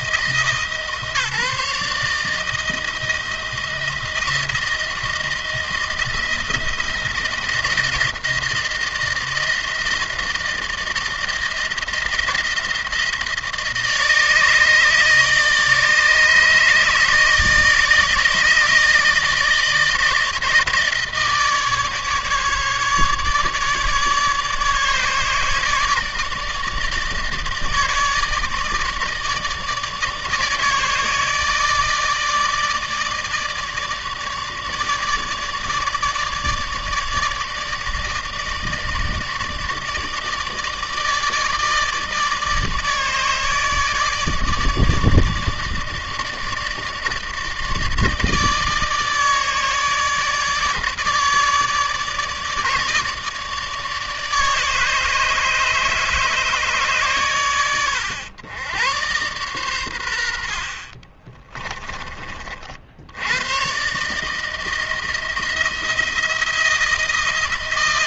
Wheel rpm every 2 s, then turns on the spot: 160, 160, 170, 160, 160, 160, 160, 150, 150, 160, 160, 150, 150, 150, 160, 150, 160, 150, 150, 160, 150, 150, 150, 150, 150, 150, 150, 150, 150, 110, 60, 50, 160, 170.
60-62